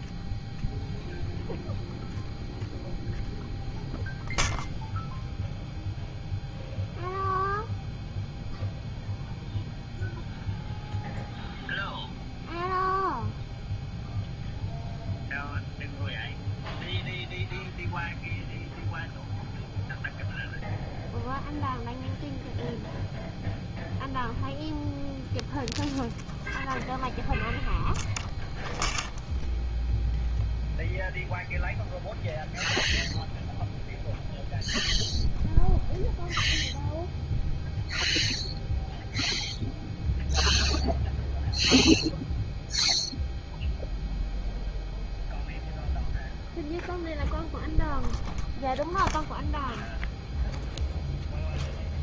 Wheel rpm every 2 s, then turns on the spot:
0, 0, 0, 0, 0, 0, 0, 0, 0, 0, 0, 0, 0, 0, 0, 0, 0, 0, 0, 0, 0, 0, 0, 0, 0, 0.
none